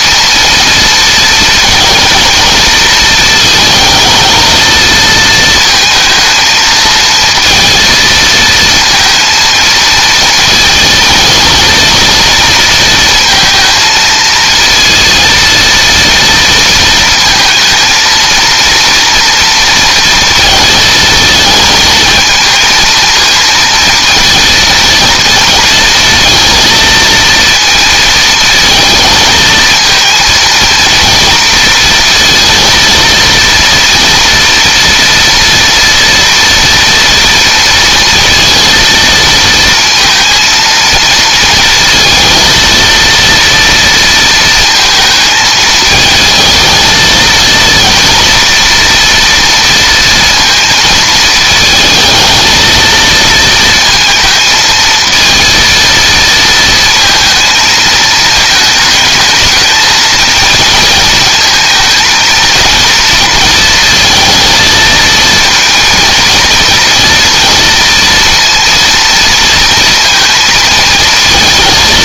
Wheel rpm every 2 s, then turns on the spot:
230, 230, 220, 220, 230, 220, 230, 230, 230, 230, 230, 230, 230, 230, 220, 230, 230, 230, 230, 230, 230, 230, 230, 220, 230, 230, 230, 230, 230, 220, 230, 230, 220, 230, 230, 230.
none